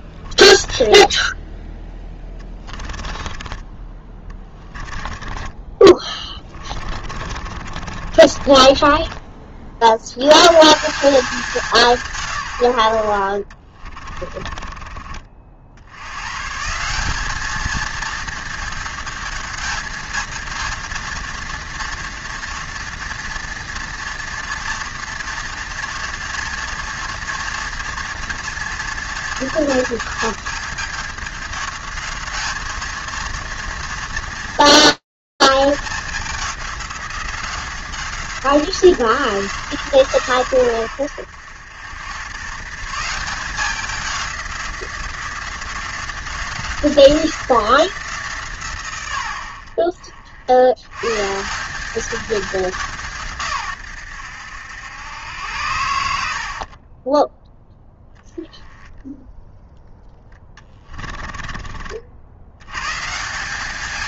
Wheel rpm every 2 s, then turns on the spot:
20, 20, 20, 30, 30, 150, 110, 30, 150, 220, 230, 230, 230, 230, 230, 210, 220, 230, 180, 170, 90, 160, 180, 180, 100, 100, 190, 90, 40, 0, 20, 100.
0-10 14-16 60-62